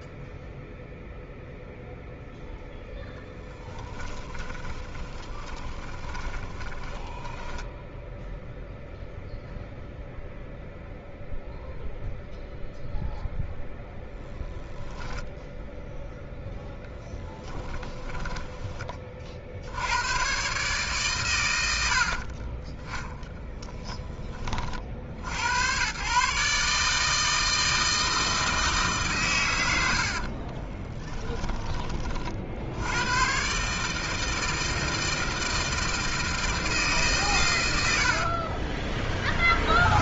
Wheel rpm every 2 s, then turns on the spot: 0, 0, 10, 10, 0, 0, 0, 10, 0, 10, 130, 40, 10, 140, 160, 30, 70, 160, 160, 30.
4-8 30-32 38-40